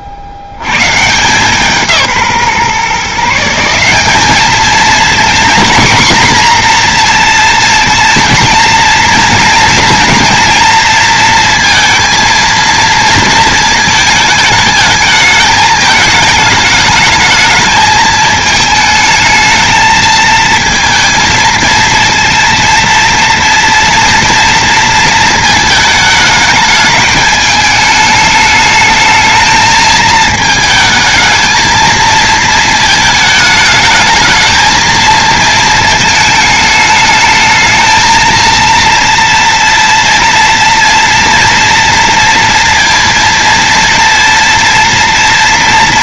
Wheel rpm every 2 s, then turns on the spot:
60, 150, 220, 240, 230, 230, 230, 220, 210, 220, 230, 230, 230, 220, 220, 220, 220, 220, 210, 230, 230, 230, 230.
none